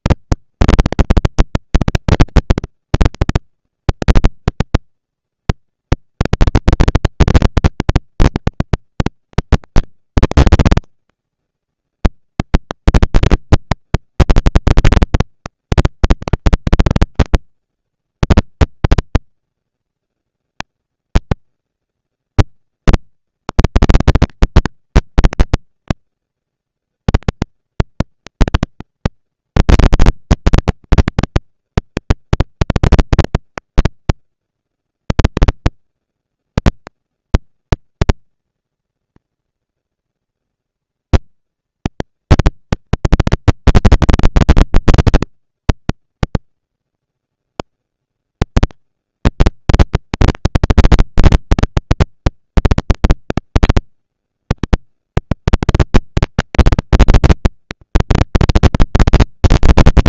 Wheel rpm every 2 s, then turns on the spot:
230, 230, 230, 230, 230, 230, 220, 200, 190, 220, 220, 220, 230, 230, 230, 230, 230, 230, 230, 230, 230, 230, 230, 240, 230, 230, 230, 240, 230, 230.
none